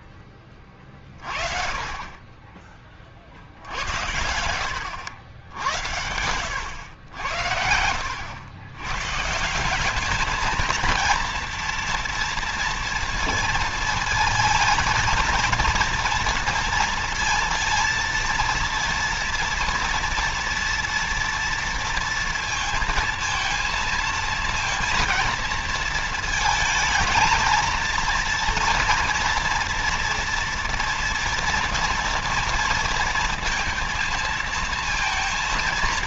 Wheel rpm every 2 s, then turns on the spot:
30, 40, 80, 100, 130, 220, 230, 230, 230, 230, 230, 230, 230, 220, 230, 230, 230, 230.
none